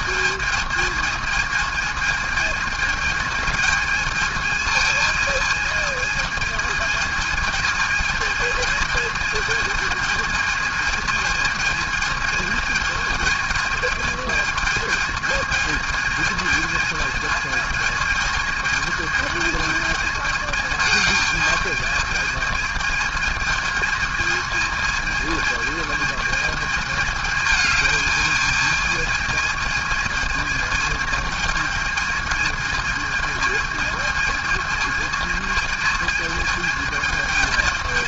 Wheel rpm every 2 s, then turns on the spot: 220, 220, 220, 220, 220, 220, 220, 220, 220, 220, 220, 220, 220, 220, 220, 220, 220, 220, 220.
none